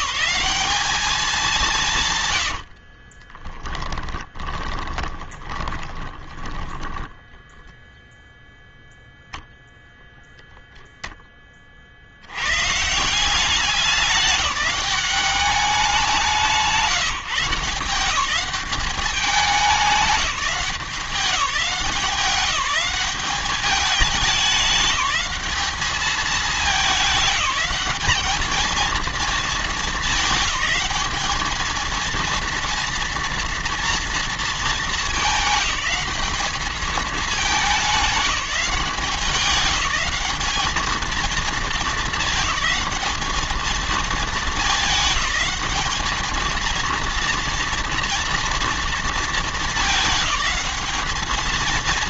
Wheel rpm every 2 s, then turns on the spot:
210, 70, 20, 20, 0, 0, 150, 200, 180, 200, 180, 190, 200, 200, 220, 210, 230, 220, 210, 190, 220, 210, 220, 230, 230, 210.
2-8